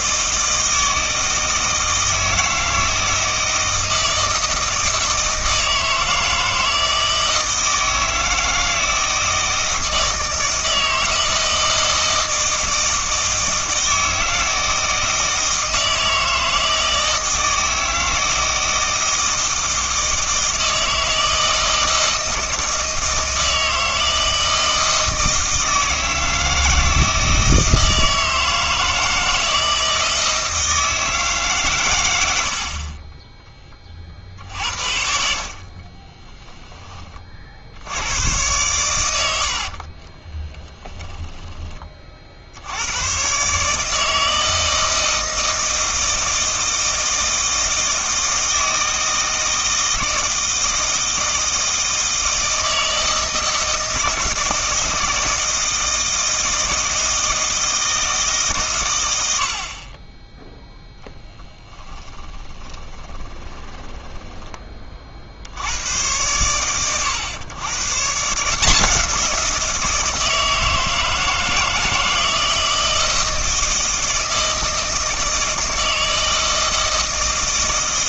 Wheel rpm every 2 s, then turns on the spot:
160, 160, 160, 160, 160, 160, 160, 160, 160, 160, 160, 160, 160, 160, 160, 160, 40, 70, 10, 110, 30, 80, 160, 160, 160, 160, 160, 160, 160, 130, 0, 30, 20, 120, 170, 160, 160, 160, 160.
40-42 62-64